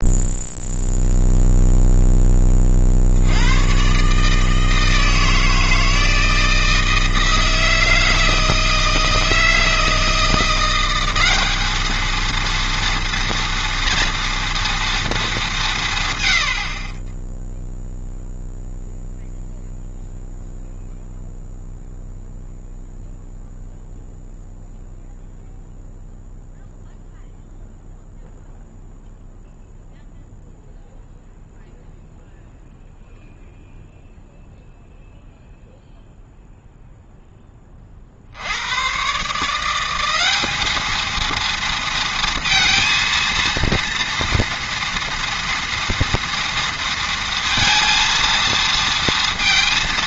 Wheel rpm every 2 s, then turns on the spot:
0, 70, 160, 160, 160, 180, 230, 230, 40, 0, 0, 0, 0, 0, 0, 0, 0, 0, 0, 110, 220, 230, 230, 230, 230.
none